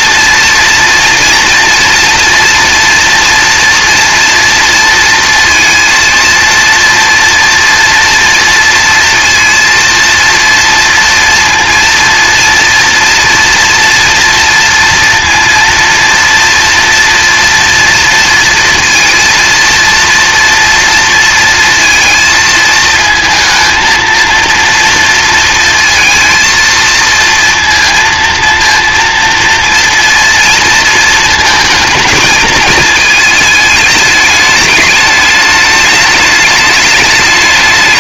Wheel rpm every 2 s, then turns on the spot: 230, 230, 230, 230, 230, 230, 230, 230, 230, 230, 230, 220, 230, 230, 230, 230, 220, 210, 210.
none